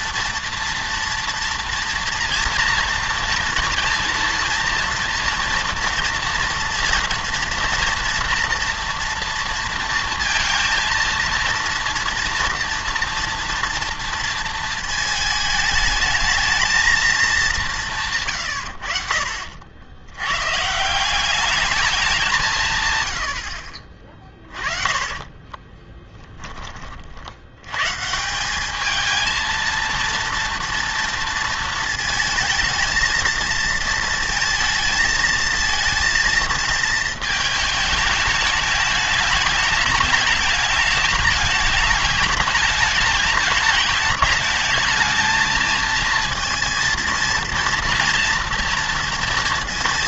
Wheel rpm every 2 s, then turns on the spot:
230, 230, 230, 240, 230, 230, 230, 220, 230, 110, 150, 120, 20, 30, 200, 230, 230, 230, 220, 210, 210, 220, 220, 230, 230.
18-20 24-26